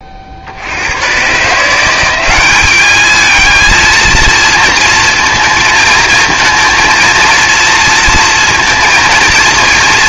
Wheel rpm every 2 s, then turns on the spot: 70, 200, 230, 230, 230.
none